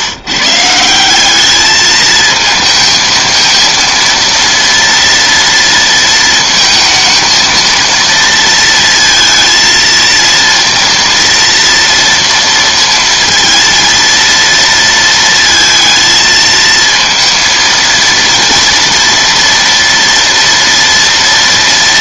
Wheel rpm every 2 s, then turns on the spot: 150, 220, 230, 230, 230, 230, 230, 230, 220, 230, 230.
none